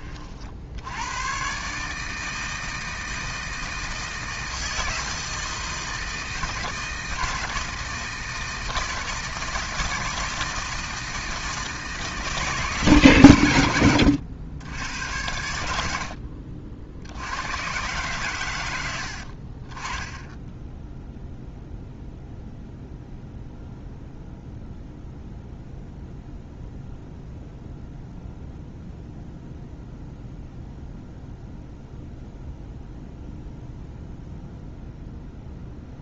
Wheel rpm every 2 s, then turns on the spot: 70, 160, 160, 160, 160, 160, 150, 90, 60, 100, 10, 0, 0, 0, 0, 0, 0, 0.
none